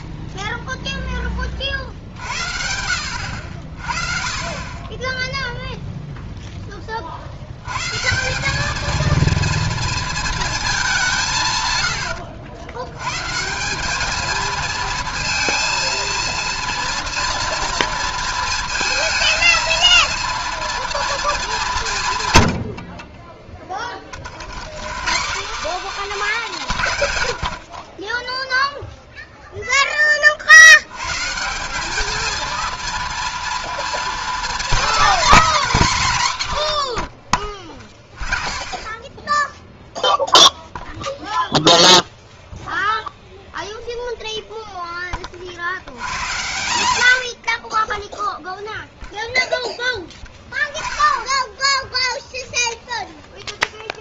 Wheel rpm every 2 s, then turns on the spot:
30, 30, 0, 160, 230, 90, 210, 230, 230, 230, 170, 30, 260, 20, 20, 220, 230, 210, 20, 0, 0, 0, 70, 20, 0, 10, 0.
36-38